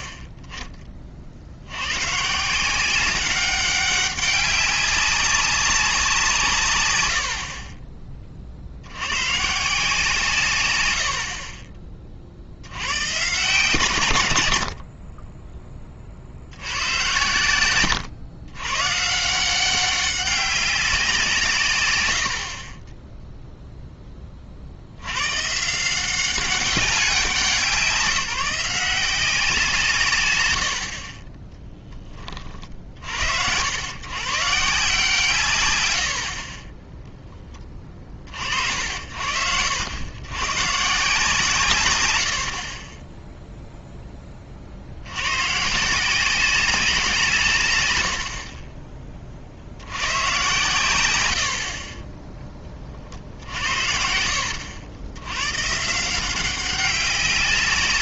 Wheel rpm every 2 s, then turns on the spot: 30, 180, 200, 140, 70, 100, 90, 70, 70, 120, 190, 40, 60, 190, 170, 80, 40, 160, 30, 60, 130, 50, 50, 190, 40, 110, 20, 80, 190.
none